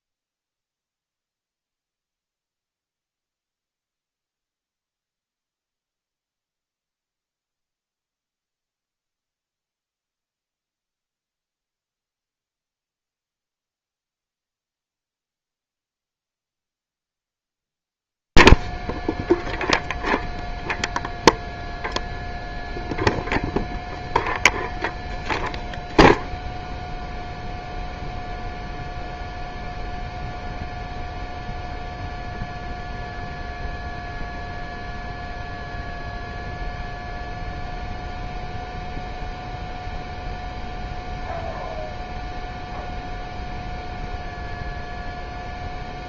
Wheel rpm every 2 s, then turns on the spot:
0, 0, 0, 0, 0, 0, 0, 0, 0, 0, 0, 0, 0, 0, 0, 0, 0, 0, 0, 0, 0, 0, 0.
none